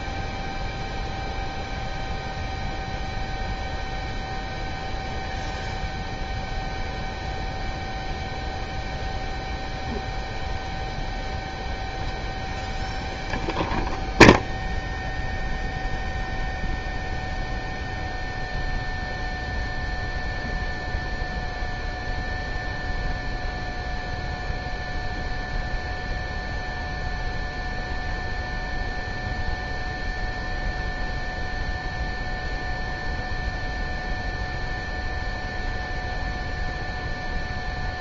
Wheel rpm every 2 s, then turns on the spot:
0, 0, 0, 0, 0, 0, 0, 0, 0, 0, 0, 0, 0, 0, 0, 0, 0, 0, 0.
none